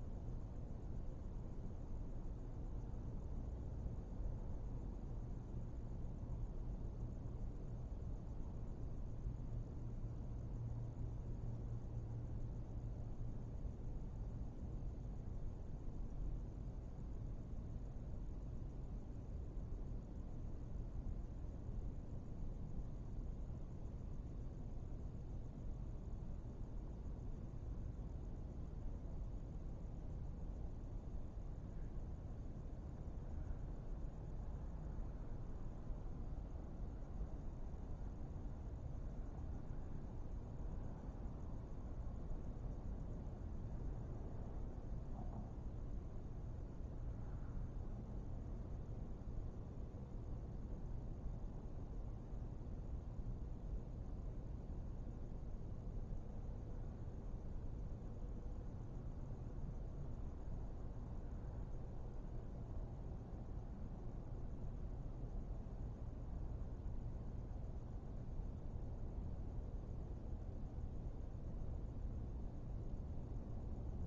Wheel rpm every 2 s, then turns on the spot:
0, 0, 0, 0, 0, 0, 0, 0, 0, 0, 0, 0, 0, 0, 0, 0, 0, 0, 0, 0, 0, 0, 0, 0, 0, 0, 0, 0, 0, 0, 0, 0, 0, 0, 0, 0, 0.
none